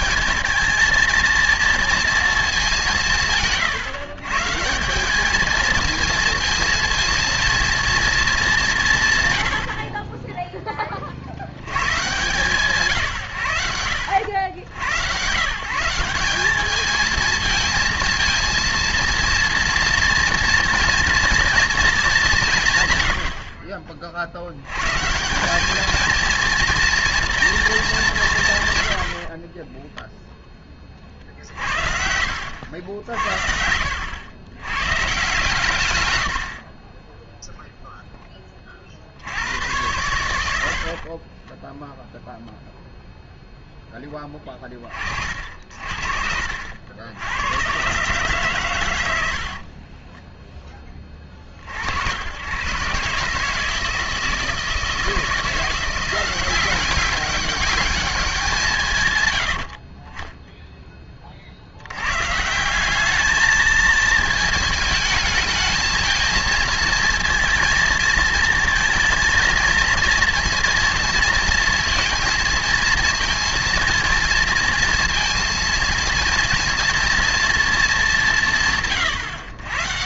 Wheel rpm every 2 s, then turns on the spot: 230, 190, 160, 230, 200, 20, 160, 90, 200, 230, 230, 150, 90, 230, 130, 20, 80, 110, 50, 20, 80, 0, 30, 70, 130, 10, 120, 160, 190, 160, 0, 160, 220, 230, 230, 230, 230, 230, 230, 150.
none